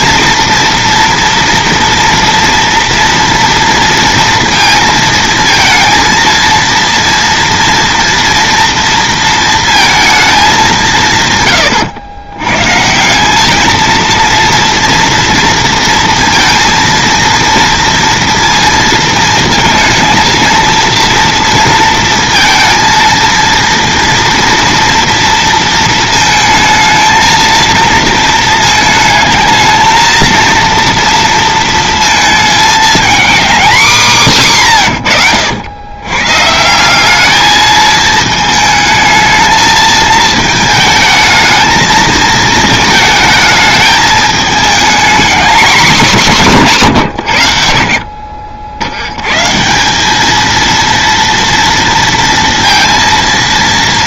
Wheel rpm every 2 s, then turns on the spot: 230, 230, 230, 230, 230, 200, 140, 230, 230, 230, 230, 230, 230, 220, 220, 230, 220, 130, 140, 220, 220, 220, 220, 180, 70, 220, 230.
none